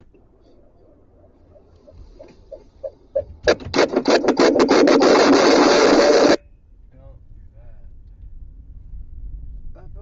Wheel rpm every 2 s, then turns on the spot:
0, 0, 0, 0, 0.
none